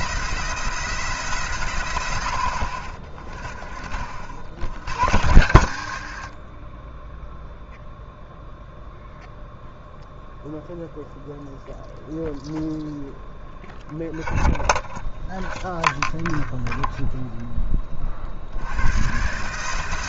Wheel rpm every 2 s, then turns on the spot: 170, 60, 100, 30, 0, 0, 0, 0, 0, 90.
none